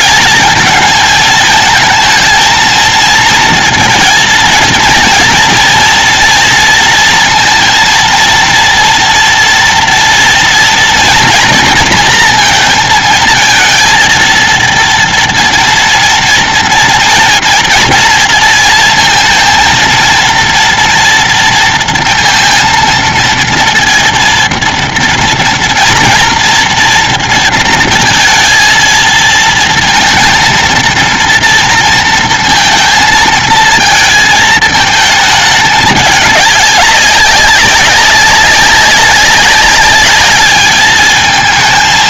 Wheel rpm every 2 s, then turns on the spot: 220, 230, 230, 230, 230, 230, 220, 230, 230, 230, 230, 230, 230, 230, 220, 230, 230, 210, 200, 200, 220.
none